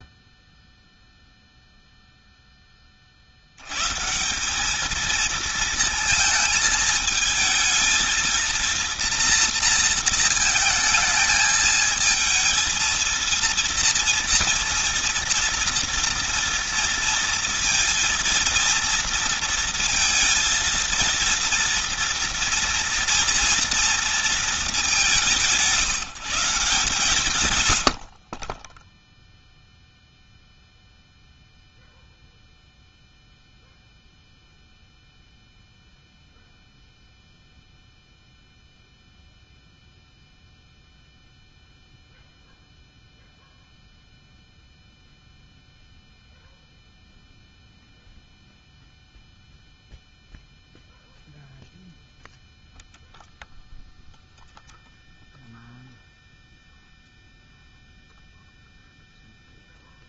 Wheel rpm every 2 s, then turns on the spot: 0, 20, 200, 220, 230, 220, 220, 230, 230, 230, 230, 230, 210, 160, 30, 0, 0, 0, 0, 0, 0, 0, 0, 0, 0, 0, 0, 0, 0, 0.
none